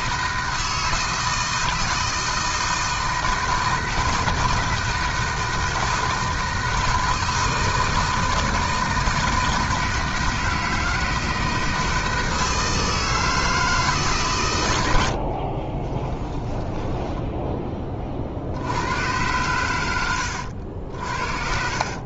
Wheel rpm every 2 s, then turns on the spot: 160, 160, 160, 160, 160, 160, 160, 130, 20, 50, 90.
16-18